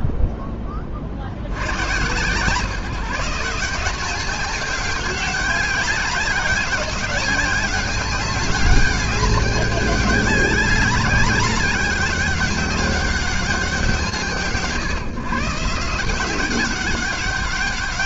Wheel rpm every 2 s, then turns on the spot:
30, 160, 200, 200, 200, 200, 200, 140, 200.
none